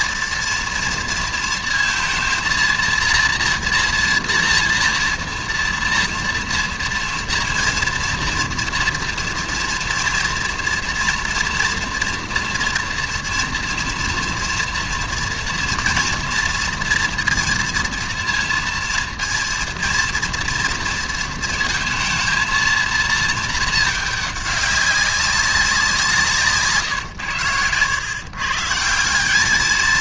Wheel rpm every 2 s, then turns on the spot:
230, 230, 230, 230, 230, 230, 230, 240, 230, 230, 230, 230, 200, 160, 150.
none